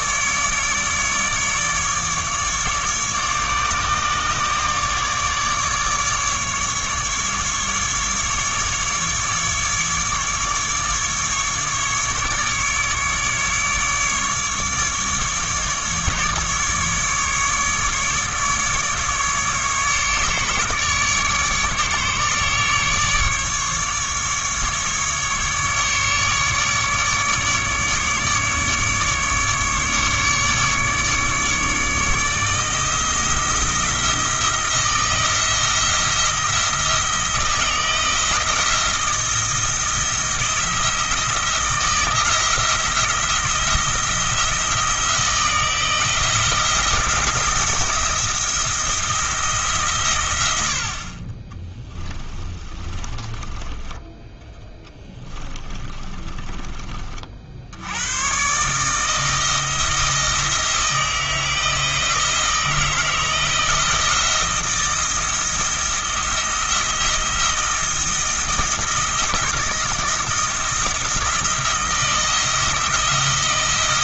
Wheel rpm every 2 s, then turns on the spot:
150, 150, 150, 150, 150, 150, 150, 150, 150, 150, 150, 150, 150, 150, 150, 150, 160, 170, 160, 170, 170, 170, 170, 170, 170, 60, 20, 10, 30, 150, 160, 160, 170, 170, 160, 170, 160.
52-56